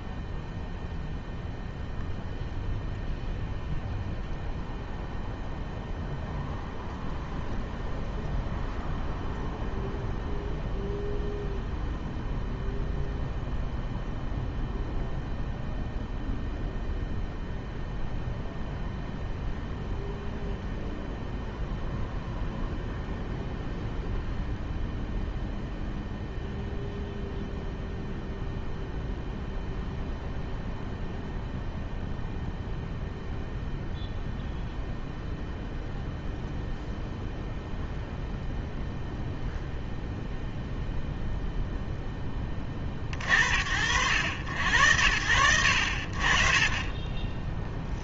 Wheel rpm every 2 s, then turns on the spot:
0, 0, 0, 0, 0, 0, 0, 0, 0, 0, 0, 0, 0, 0, 0, 0, 0, 0, 0, 0, 0, 0, 80, 50.
none